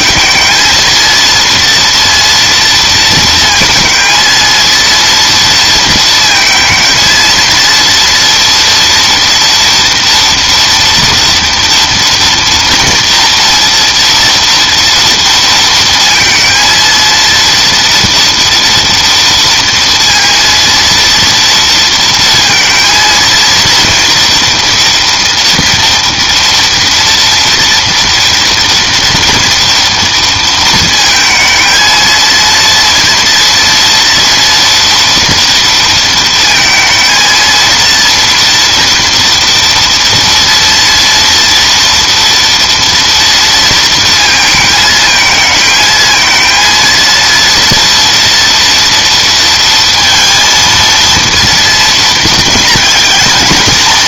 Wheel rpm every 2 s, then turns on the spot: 220, 230, 230, 230, 230, 230, 230, 230, 230, 230, 230, 230, 230, 230, 240, 230, 230, 230, 220, 230, 230, 240, 220, 230, 230, 230, 230.
none